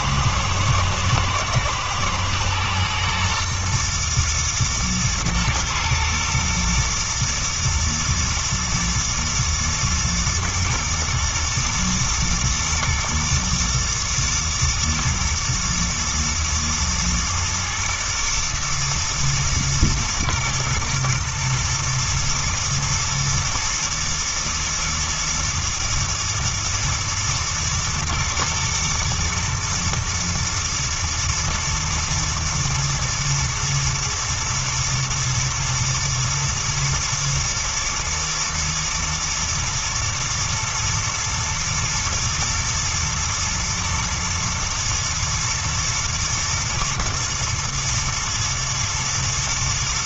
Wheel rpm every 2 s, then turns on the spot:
110, 110, 120, 120, 120, 110, 120, 120, 120, 120, 120, 120, 120, 110, 120, 110, 110, 110, 110, 120, 120, 110, 110, 120, 120.
none